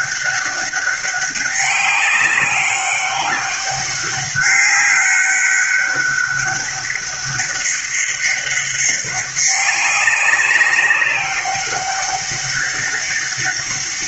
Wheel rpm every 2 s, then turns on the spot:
200, 200, 190, 200, 200, 200, 200.
none